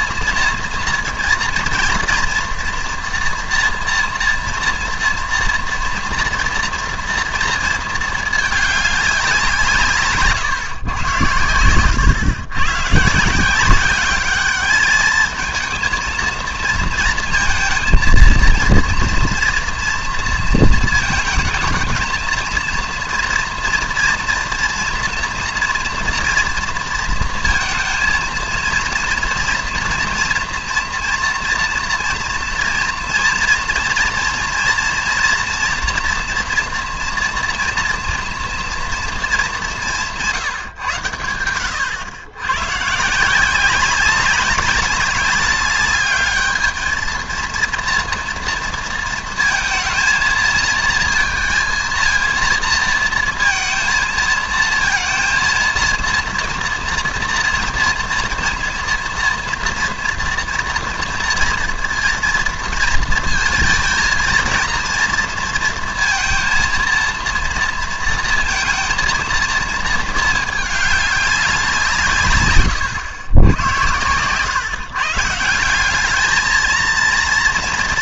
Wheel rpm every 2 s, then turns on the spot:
230, 230, 230, 230, 210, 140, 120, 210, 230, 230, 230, 230, 230, 230, 230, 230, 240, 230, 230, 230, 150, 110, 200, 210, 230, 230, 230, 220, 230, 230, 230, 230, 230, 230, 230, 210, 110, 140, 220.
72-74